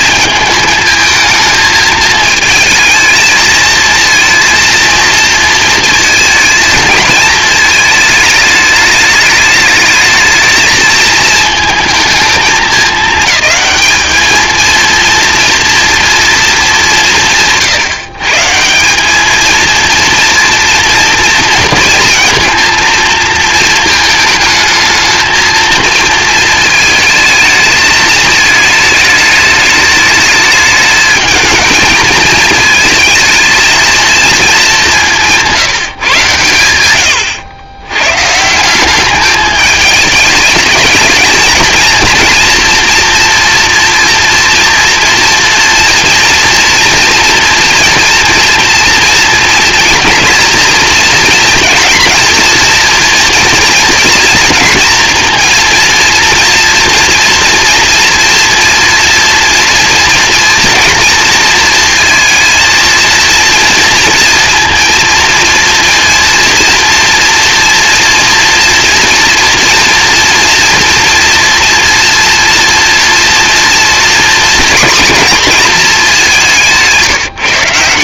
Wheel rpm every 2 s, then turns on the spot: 220, 220, 230, 220, 210, 220, 210, 230, 180, 200, 230, 230, 220, 220, 220, 220, 220, 190, 100, 200, 220, 230, 240, 230, 230, 230, 240, 230, 230, 230, 230, 230, 230, 230, 230, 240, 230, 230, 160.
36-38 76-78